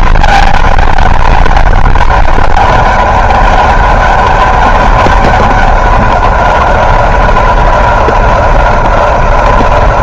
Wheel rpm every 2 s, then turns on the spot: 200, 200, 200, 190, 180.
none